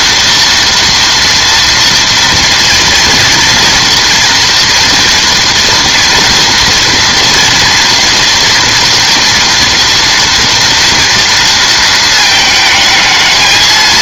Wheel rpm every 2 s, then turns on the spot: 230, 230, 240, 230, 230, 230, 220.
none